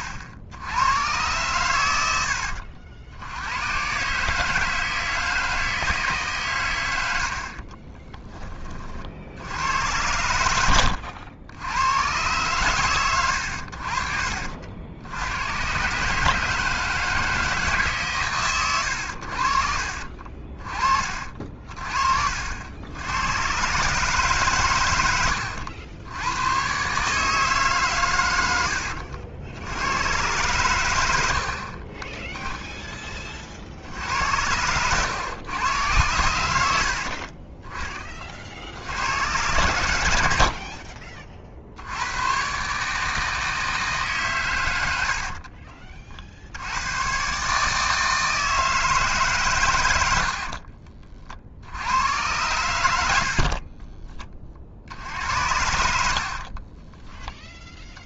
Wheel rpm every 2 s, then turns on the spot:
70, 80, 160, 120, 20, 90, 110, 70, 160, 110, 40, 80, 130, 120, 90, 120, 0, 90, 80, 60, 50, 130, 110, 90, 160, 60, 110, 40, 40.
10-12 28-30 34-36 40-42 50-52 56-58